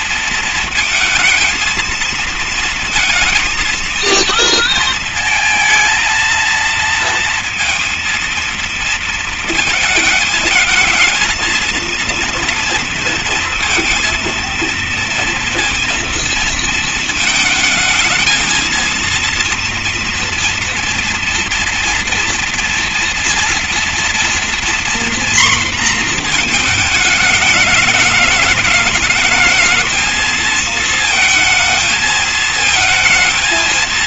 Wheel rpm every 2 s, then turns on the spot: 220, 230, 230, 230, 230, 230, 230, 230, 220, 230, 230, 230, 230, 210, 220, 230, 230.
none